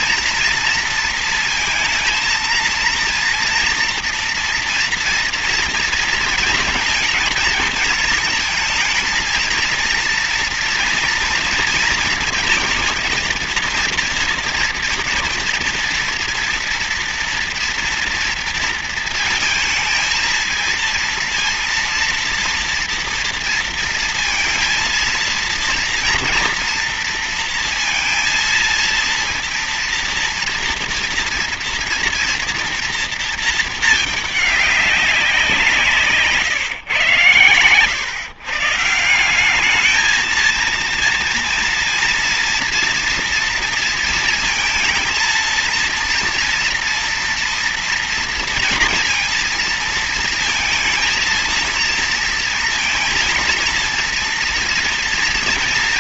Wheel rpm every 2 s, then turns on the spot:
230, 230, 230, 230, 230, 230, 230, 230, 230, 230, 230, 230, 230, 230, 230, 230, 230, 210, 130, 140, 220, 230, 230, 230, 230, 230, 230, 230.
none